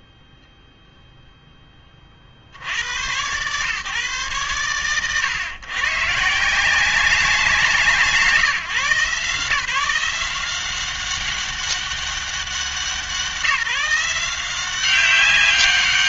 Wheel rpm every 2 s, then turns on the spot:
0, 90, 110, 170, 160, 190, 190, 190.
none